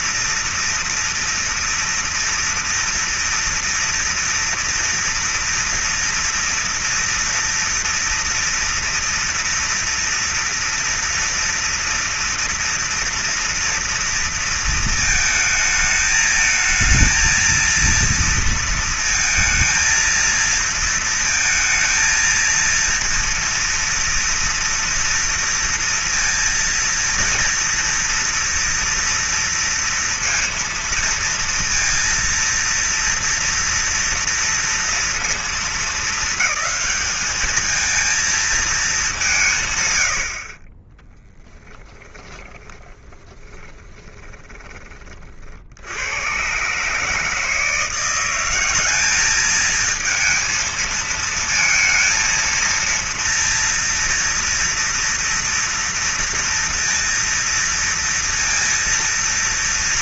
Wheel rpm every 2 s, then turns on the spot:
230, 230, 230, 230, 230, 230, 240, 230, 220, 230, 230, 230, 230, 230, 230, 230, 230, 230, 210, 220, 20, 10, 30, 140, 200, 230, 230, 230, 230, 230.
42-44